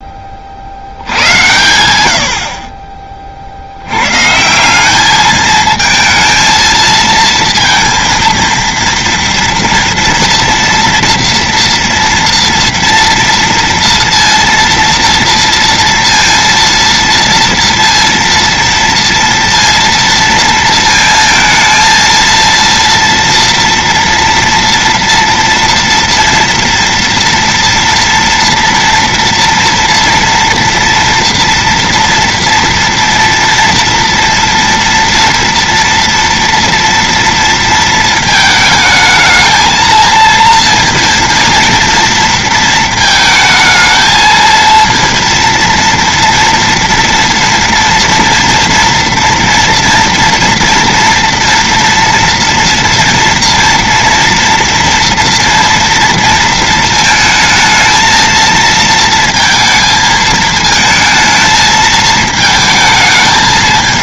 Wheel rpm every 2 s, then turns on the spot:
20, 80, 130, 220, 230, 240, 230, 230, 230, 230, 230, 230, 230, 230, 230, 230, 230, 230, 240, 220, 230, 230, 220, 230, 240, 230, 230, 230, 230, 230, 220, 220.
none